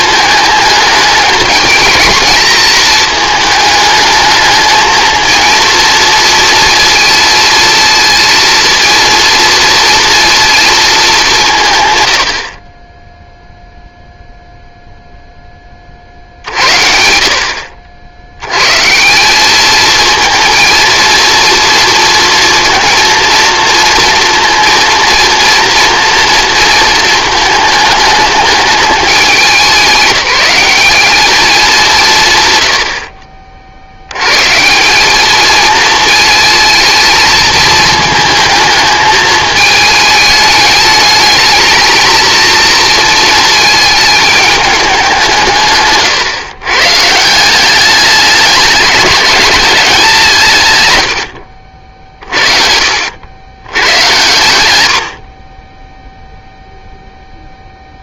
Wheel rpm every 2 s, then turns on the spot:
210, 210, 220, 230, 230, 220, 20, 0, 60, 150, 230, 230, 230, 230, 210, 190, 80, 180, 220, 220, 210, 220, 200, 130, 210, 120, 70, 90, 0.
none